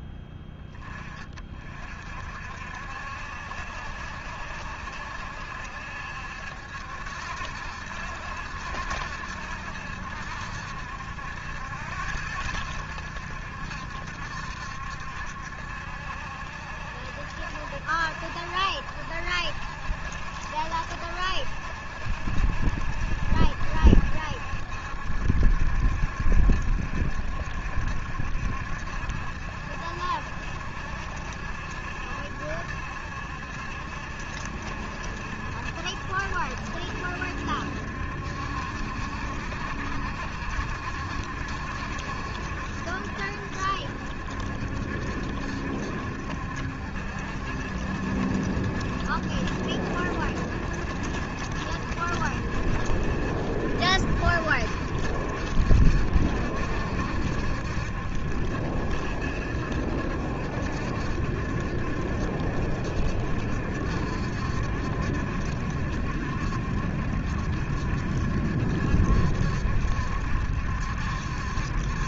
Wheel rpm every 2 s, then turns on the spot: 20, 60, 70, 70, 70, 70, 90, 70, 70, 70, 70, 70, 70, 70, 70, 70, 70, 70, 70, 70, 70, 70, 70, 70, 70, 70, 70, 70, 70, 70, 70, 60, 70, 70, 70, 70.
none